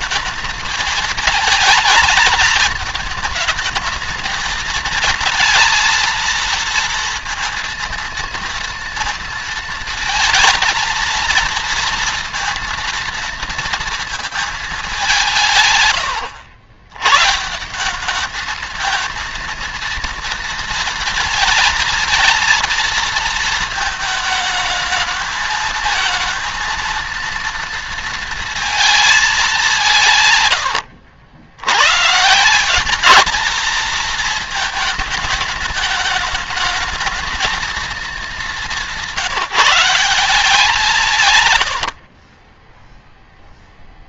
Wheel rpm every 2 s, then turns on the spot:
210, 210, 220, 230, 230, 230, 230, 220, 110, 220, 230, 230, 220, 230, 230, 110, 190, 220, 210, 180, 180, 20.
30-32